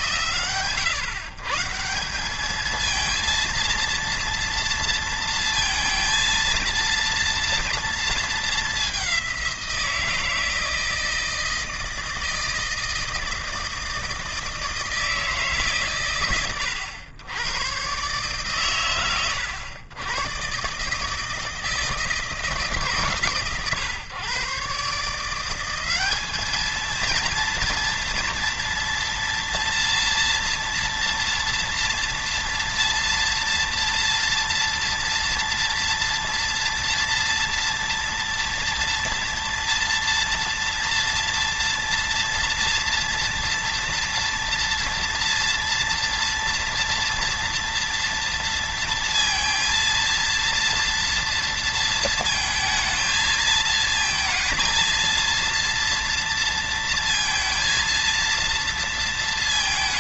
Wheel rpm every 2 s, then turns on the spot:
140, 220, 230, 230, 200, 160, 160, 160, 100, 130, 140, 150, 150, 220, 230, 240, 230, 230, 230, 230, 230, 230, 230, 230, 230, 230, 230, 230, 230, 230.
none